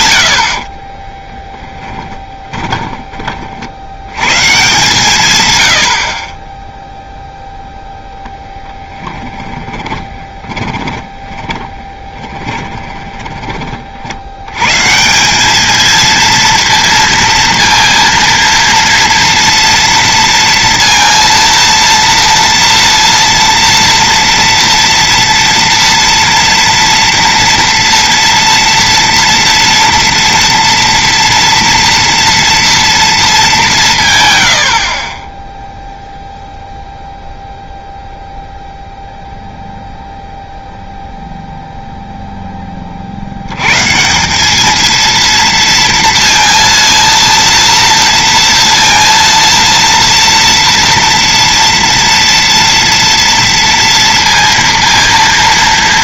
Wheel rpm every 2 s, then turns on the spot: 40, 20, 130, 10, 10, 20, 20, 120, 230, 230, 230, 230, 230, 230, 230, 240, 230, 70, 0, 0, 0, 20, 210, 230, 230, 230, 230, 230.
0-4 8-14 34-36